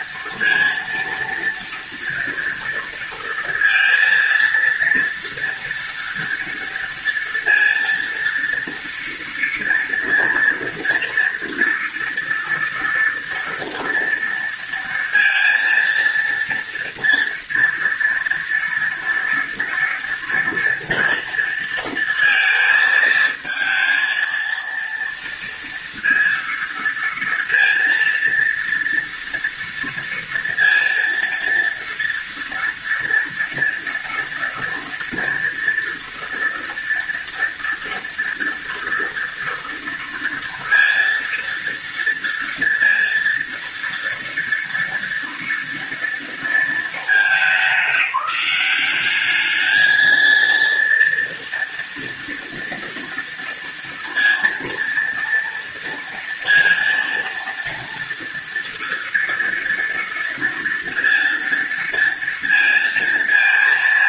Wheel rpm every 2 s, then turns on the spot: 230, 230, 230, 230, 230, 230, 230, 230, 230, 230, 230, 220, 230, 230, 230, 230, 230, 230, 230, 230, 230, 230, 230, 220, 200, 230, 230, 230, 230, 230, 230, 230.
none